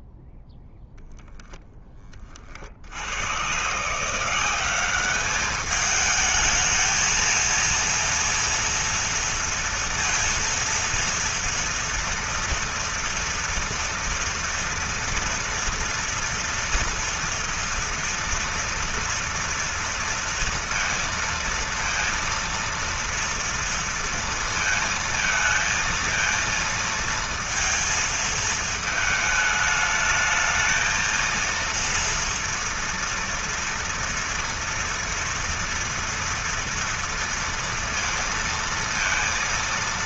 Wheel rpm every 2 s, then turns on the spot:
0, 70, 200, 220, 230, 230, 230, 230, 240, 230, 230, 230, 230, 230, 220, 220, 230, 230, 230, 230.
none